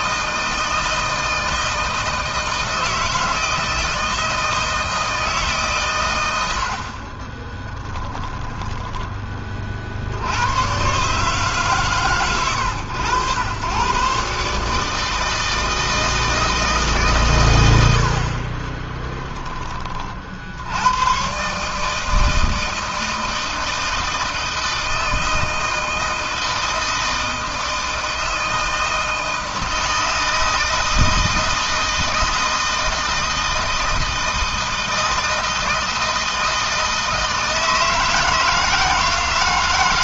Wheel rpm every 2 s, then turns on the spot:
160, 160, 160, 60, 10, 130, 100, 150, 150, 20, 100, 160, 160, 160, 160, 160, 160, 160, 160, 160.
6-8 18-20